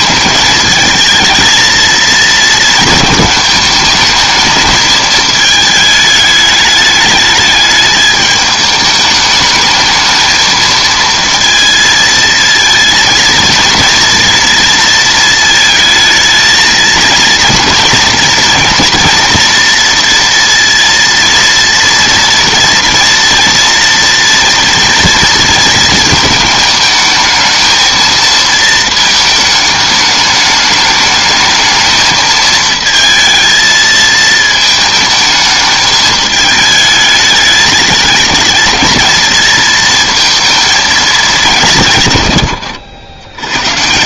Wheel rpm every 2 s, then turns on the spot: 220, 230, 220, 210, 210, 220, 230, 230, 220, 230, 230, 240, 230, 220, 230, 210, 220, 220, 210, 220, 230, 100.
none